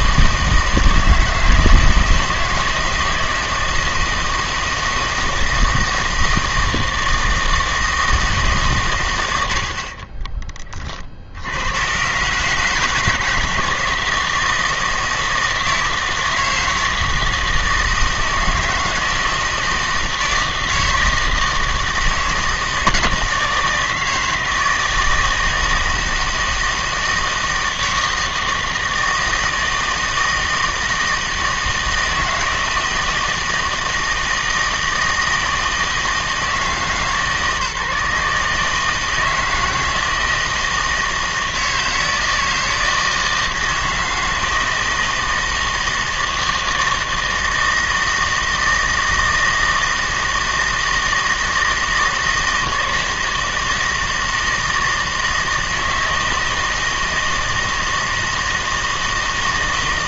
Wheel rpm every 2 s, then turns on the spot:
160, 160, 160, 160, 130, 20, 150, 160, 160, 160, 160, 160, 160, 160, 160, 160, 160, 160, 160, 150, 160, 160, 160, 160, 160, 160, 160, 160, 160, 160.
none